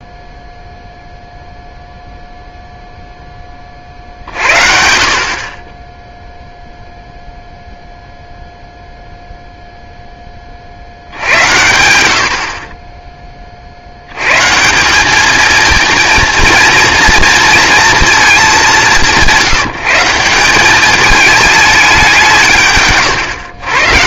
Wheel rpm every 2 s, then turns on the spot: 0, 0, 60, 0, 0, 50, 30, 150, 230, 200, 190, 150.
none